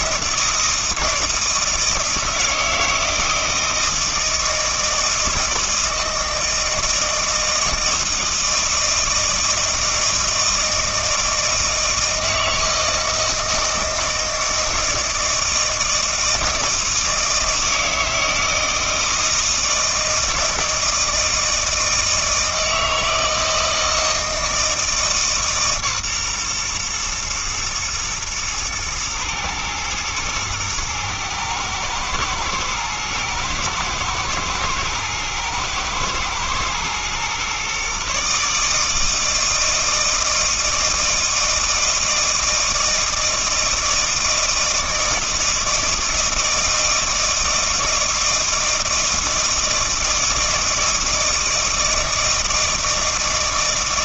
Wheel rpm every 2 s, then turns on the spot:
160, 160, 160, 160, 160, 160, 160, 160, 160, 160, 160, 160, 160, 120, 110, 110, 110, 110, 120, 160, 160, 160, 160, 160, 160, 160, 160.
none